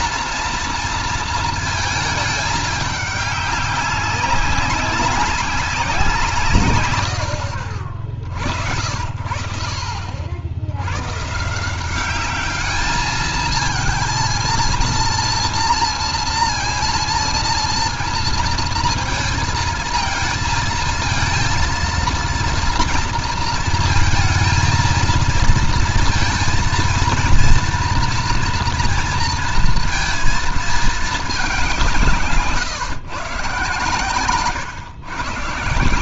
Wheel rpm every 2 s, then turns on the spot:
230, 210, 190, 140, 60, 70, 200, 230, 230, 230, 220, 230, 220, 230, 230, 230, 150, 130.
none